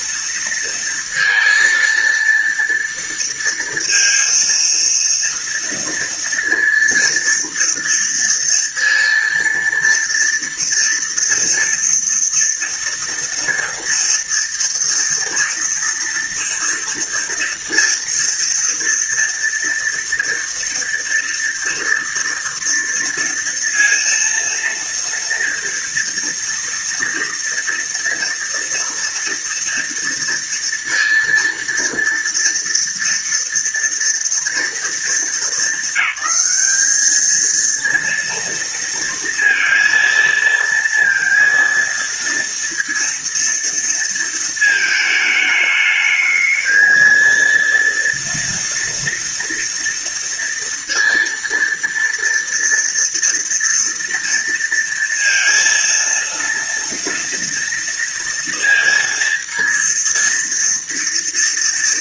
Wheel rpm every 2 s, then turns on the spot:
230, 230, 230, 230, 230, 230, 230, 230, 230, 230, 230, 230, 230, 230, 230, 230, 230, 220, 210, 230, 230, 230, 220, 230, 230, 230, 230, 230, 230, 230, 230.
none